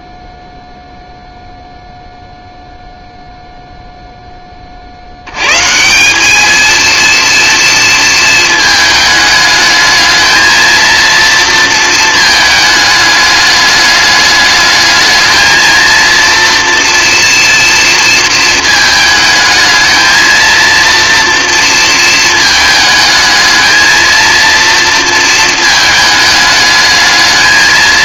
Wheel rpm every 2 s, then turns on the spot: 0, 0, 130, 230, 220, 230, 210, 230, 230, 220, 230, 220, 220, 220.
none